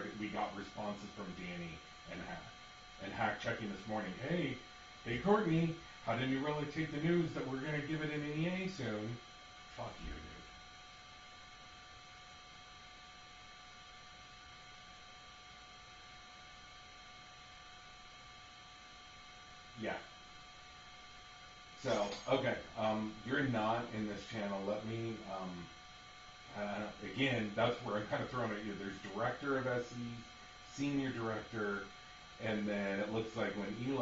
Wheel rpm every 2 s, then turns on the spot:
0, 0, 0, 0, 0, 0, 0, 0, 0, 0, 0, 0, 0, 0, 0, 0, 0.
none